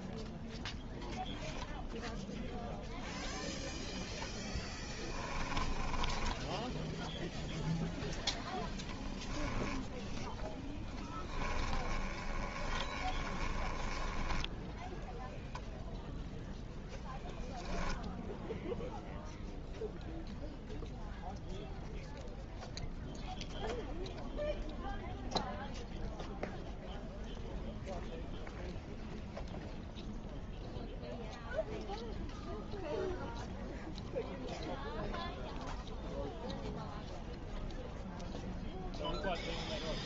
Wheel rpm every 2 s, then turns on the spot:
0, 0, 10, 10, 10, 10, 30, 10, 0, 0, 0, 0, 0, 0, 0, 0, 0, 0, 0, 0.
4-6 10-16